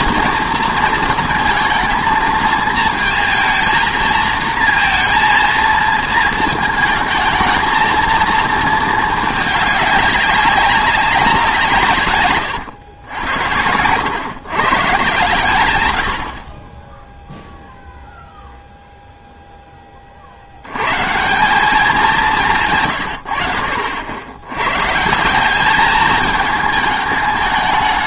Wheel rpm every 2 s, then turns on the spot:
230, 220, 230, 220, 220, 190, 110, 130, 20, 0, 100, 150, 120, 220.
none